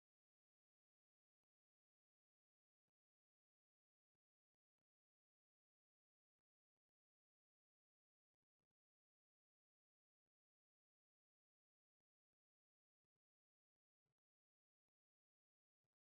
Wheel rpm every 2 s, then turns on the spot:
0, 0, 0, 0, 0, 0, 0, 0.
none